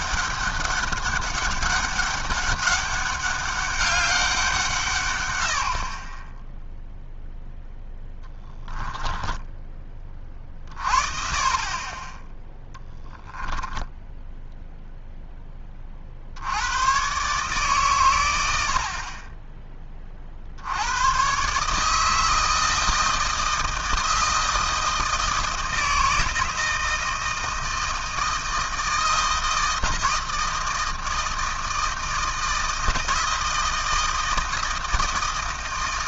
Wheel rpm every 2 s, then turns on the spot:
200, 200, 130, 0, 10, 40, 10, 0, 110, 60, 80, 160, 160, 160, 160, 160, 160, 160.
8-10